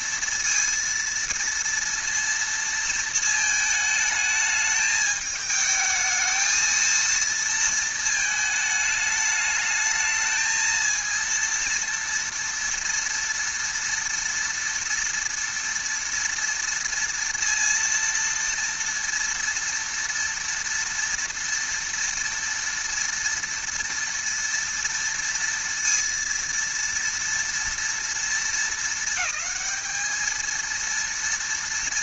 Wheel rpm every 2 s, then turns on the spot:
230, 230, 210, 230, 210, 230, 230, 230, 230, 230, 230, 230, 230, 230, 220, 230.
none